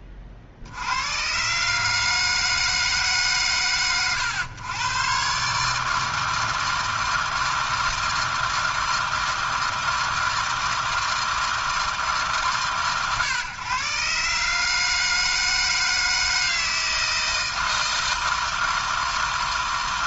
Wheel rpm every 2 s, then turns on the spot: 80, 160, 120, 160, 160, 160, 140, 150, 160, 160.
none